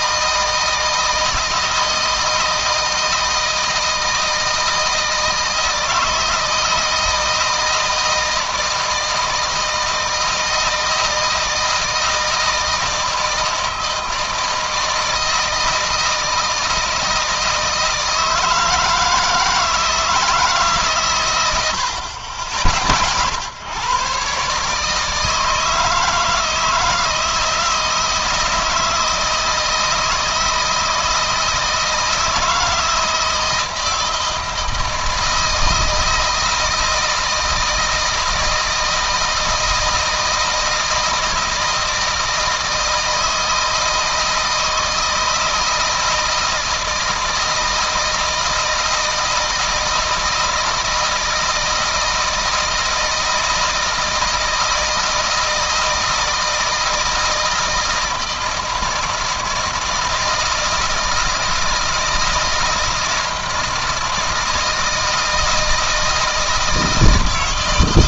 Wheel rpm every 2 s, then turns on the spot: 160, 160, 160, 160, 160, 160, 160, 160, 160, 160, 130, 90, 150, 160, 160, 160, 160, 160, 160, 160, 160, 160, 160, 160, 160, 160, 160, 160, 160, 160, 160, 160, 160, 160.
none